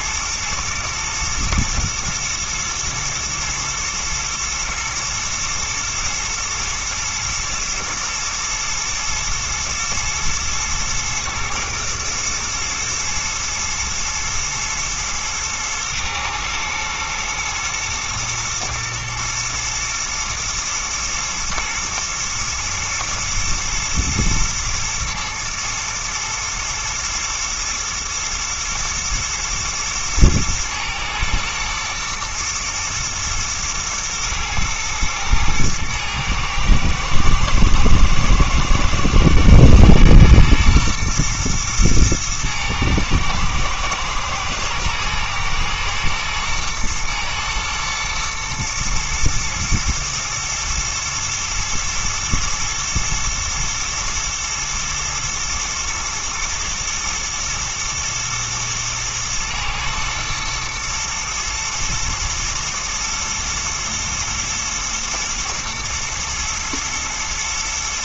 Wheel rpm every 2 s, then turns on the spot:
110, 120, 120, 120, 120, 120, 110, 110, 110, 110, 110, 110, 110, 110, 110, 110, 110, 110, 110, 110, 120, 110, 120, 120, 110, 110, 110, 110, 120, 110, 110, 110, 110, 110.
none